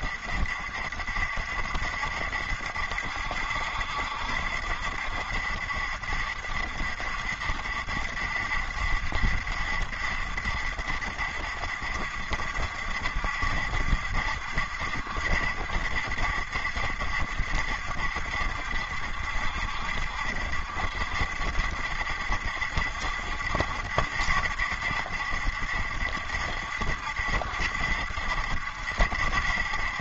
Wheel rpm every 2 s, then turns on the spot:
70, 70, 70, 70, 70, 70, 70, 70, 70, 60, 60, 70, 70, 70, 70.
none